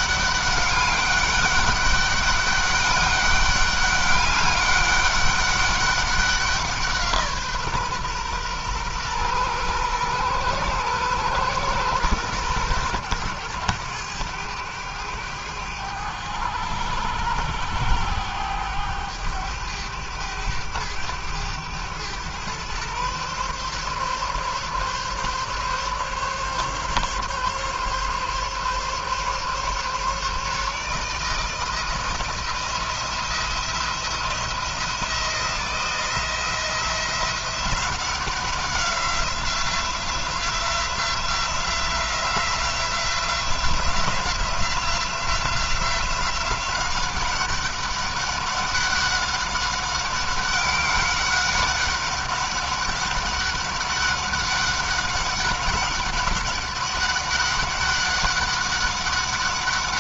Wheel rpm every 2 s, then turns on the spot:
200, 200, 200, 170, 120, 120, 110, 100, 100, 100, 100, 120, 140, 140, 140, 150, 170, 170, 170, 180, 180, 180, 180, 190, 200, 190, 190, 190, 200, 190.
none